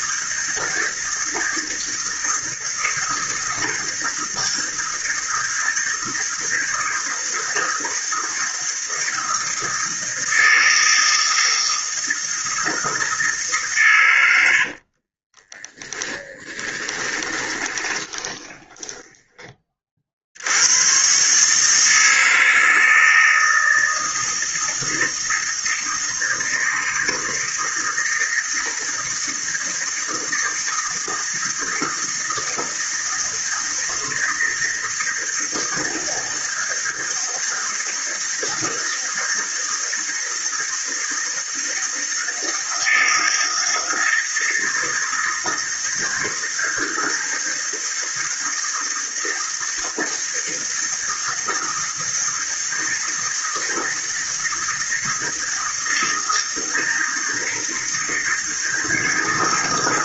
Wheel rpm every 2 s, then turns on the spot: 160, 160, 160, 160, 160, 160, 160, 60, 20, 10, 100, 160, 160, 160, 160, 160, 160, 160, 160, 160, 160, 160, 160, 160, 160, 160, 160, 160, 160, 160.
14-20